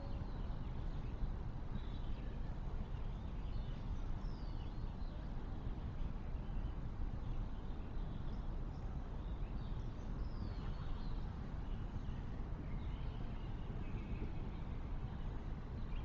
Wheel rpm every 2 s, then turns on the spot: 0, 0, 0, 0, 0, 0, 0, 0.
none